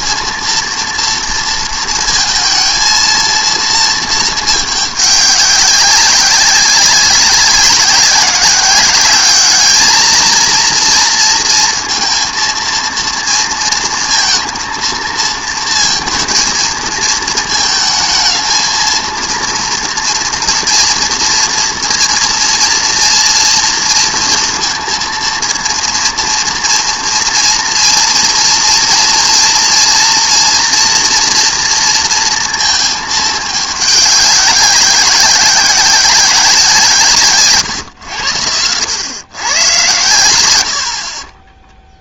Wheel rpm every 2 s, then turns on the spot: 230, 230, 200, 190, 210, 230, 230, 230, 220, 230, 230, 230, 230, 230, 240, 230, 210, 190, 130, 110, 0.
none